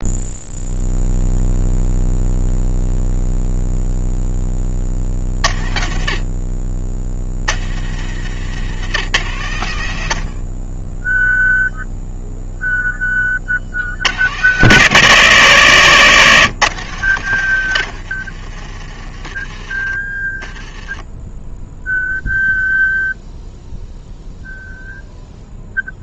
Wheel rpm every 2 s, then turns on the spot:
0, 0, 40, 60, 130, 10, 20, 120, 120, 30, 10, 0, 0.
20-22